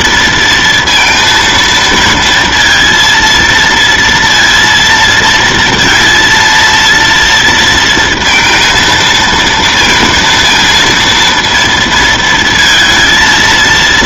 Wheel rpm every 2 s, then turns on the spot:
230, 230, 230, 230, 230, 230, 230.
none